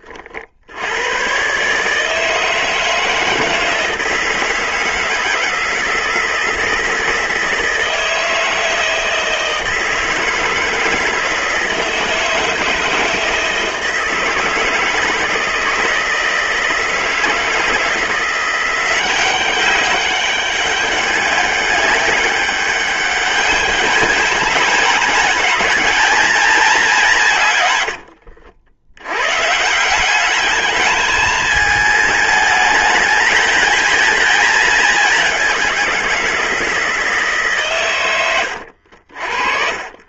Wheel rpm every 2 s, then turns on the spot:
90, 160, 160, 160, 160, 160, 160, 160, 160, 180, 200, 200, 210, 190, 90, 210, 210, 210, 160, 60.
none